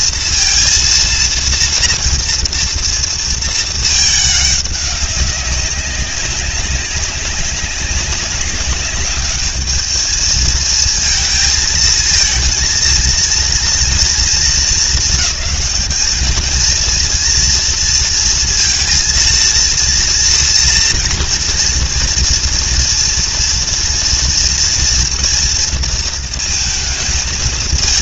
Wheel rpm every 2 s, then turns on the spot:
230, 230, 200, 190, 200, 220, 230, 220, 220, 230, 230, 230, 230, 230.
none